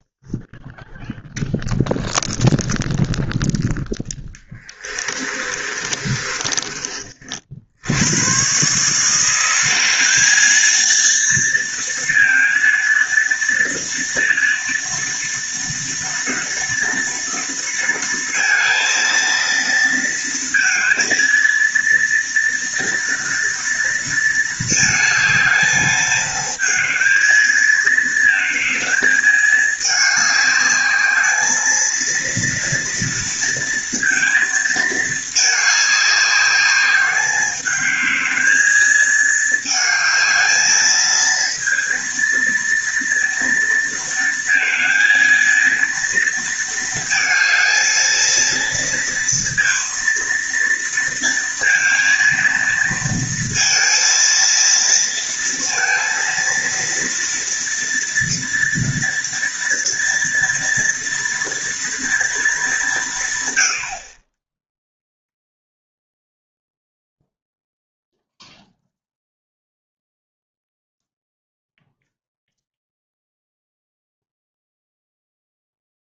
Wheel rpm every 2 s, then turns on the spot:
0, 0, 20, 30, 150, 220, 230, 230, 230, 230, 230, 230, 220, 220, 220, 210, 230, 220, 200, 220, 220, 230, 230, 220, 230, 230, 230, 230, 230, 230, 230, 210, 0, 0, 0, 0, 0, 0.
4-6